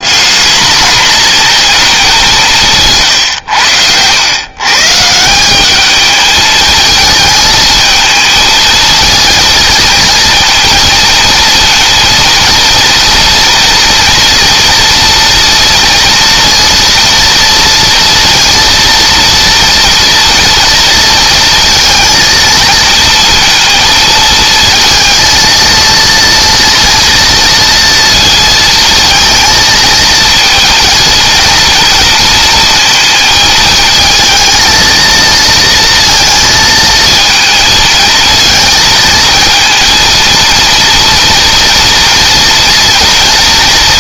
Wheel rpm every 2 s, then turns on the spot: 230, 140, 160, 220, 220, 230, 230, 230, 230, 230, 230, 230, 230, 230, 220, 230, 230, 230, 230, 220, 230, 230.
none